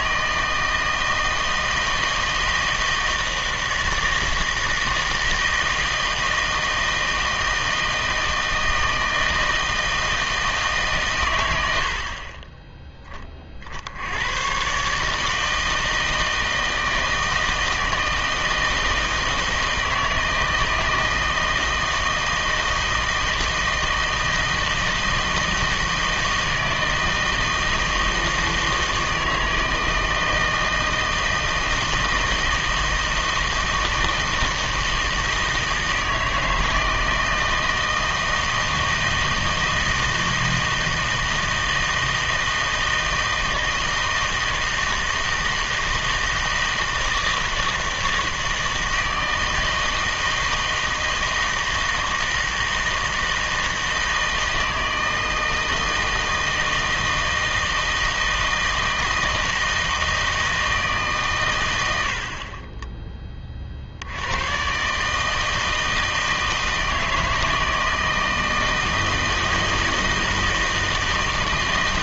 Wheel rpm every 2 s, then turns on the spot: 160, 160, 160, 160, 160, 140, 10, 130, 160, 160, 160, 160, 160, 160, 160, 160, 160, 160, 160, 160, 160, 160, 160, 160, 160, 160, 160, 160, 160, 160, 150, 20, 130, 160, 160, 160.
62-64